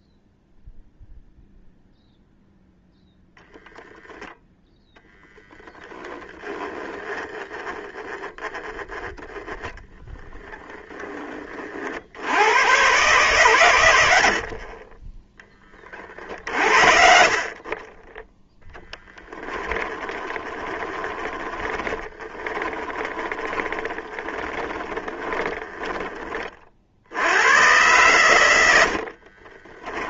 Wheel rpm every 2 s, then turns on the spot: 0, 0, 10, 10, 10, 20, 120, 20, 40, 10, 20, 20, 10, 80, 50.
18-26 28-30